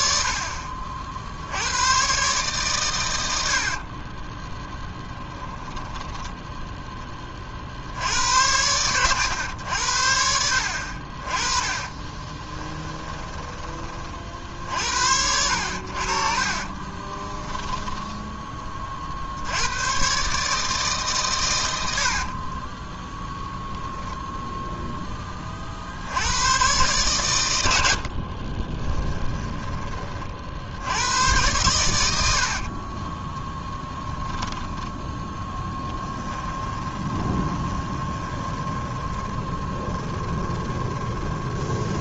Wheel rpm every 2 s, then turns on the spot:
60, 130, 10, 10, 80, 70, 30, 50, 40, 20, 150, 30, 0, 100, 30, 60, 70, 10, 20, 20, 20.
4-6 12-14 16-18 22-24 28-30 32-34 36-42